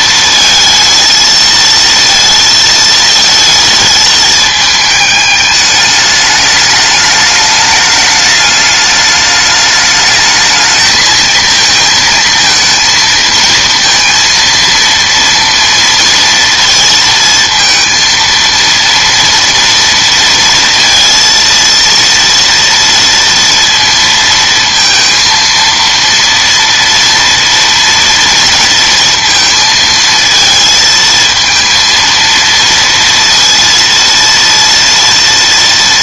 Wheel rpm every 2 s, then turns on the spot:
230, 220, 210, 210, 210, 220, 230, 230, 230, 230, 230, 240, 230, 230, 230, 230, 230, 230.
none